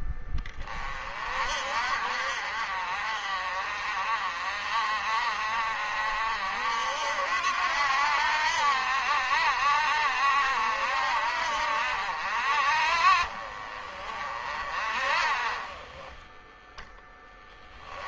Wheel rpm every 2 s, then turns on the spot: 40, 50, 50, 60, 70, 60, 50, 40, 10.
none